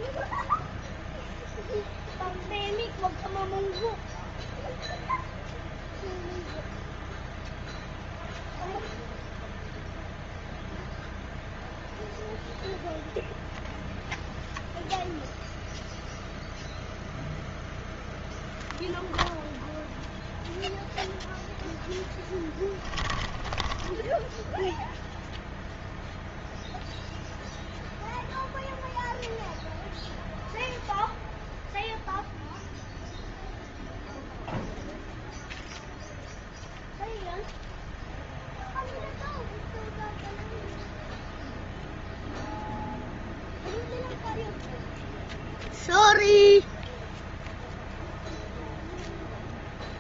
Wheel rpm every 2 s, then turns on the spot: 0, 0, 0, 0, 0, 0, 0, 0, 0, 0, 0, 10, 0, 0, 0, 0, 0, 0, 0, 0, 0, 0, 0, 0, 0.
22-24